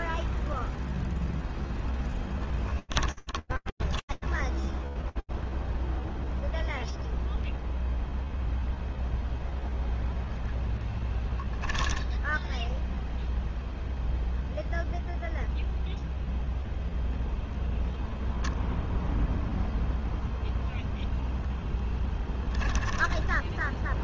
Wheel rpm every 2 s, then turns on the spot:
0, 30, 10, 0, 0, 10, 0, 0, 0, 0, 0, 10.
2-6 10-12 22-24